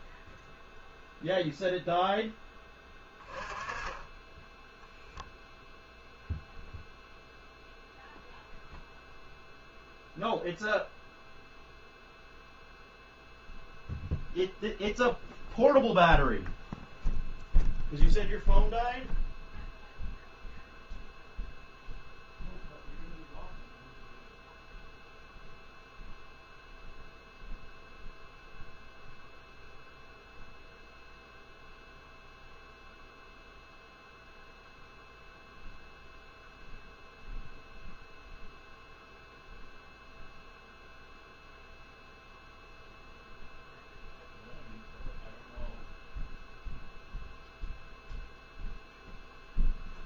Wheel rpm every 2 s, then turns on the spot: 0, 10, 0, 0, 0, 0, 0, 0, 0, 0, 0, 0, 0, 0, 0, 0, 0, 0, 0, 0, 0, 0, 0, 0, 0.
none